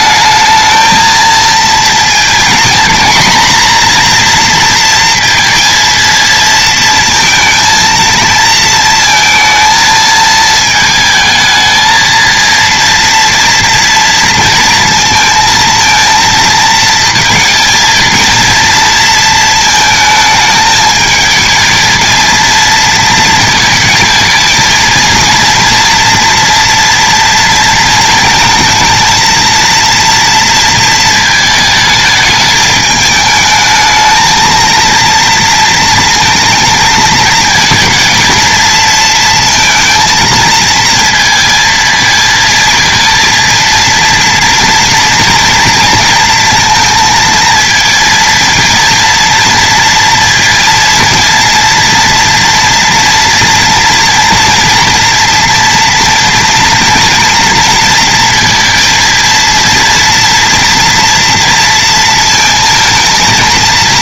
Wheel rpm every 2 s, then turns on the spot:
220, 230, 240, 230, 230, 220, 230, 230, 220, 230, 220, 230, 220, 240, 230, 230, 210, 230, 230, 230, 230, 230, 230, 230, 230, 230, 230, 230, 230, 230, 230, 230.
none